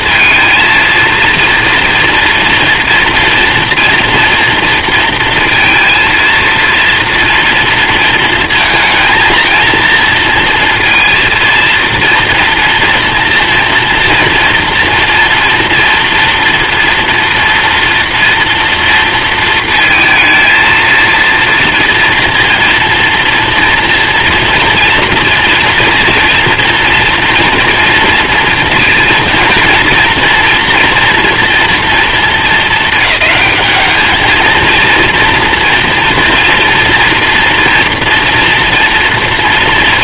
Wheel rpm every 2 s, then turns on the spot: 230, 230, 230, 230, 230, 230, 230, 230, 230, 230, 220, 230, 240, 230, 230, 230, 210, 230, 240, 230.
none